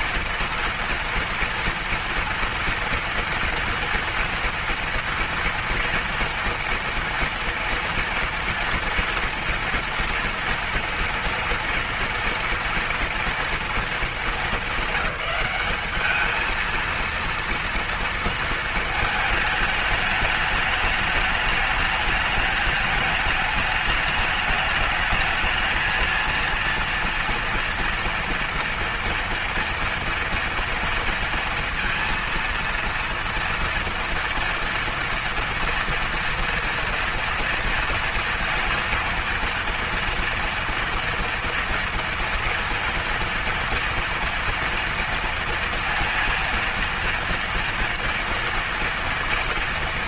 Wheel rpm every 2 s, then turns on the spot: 230, 230, 230, 230, 230, 230, 230, 210, 210, 230, 210, 210, 210, 230, 230, 230, 230, 230, 230, 230, 240, 240, 230, 230, 230.
none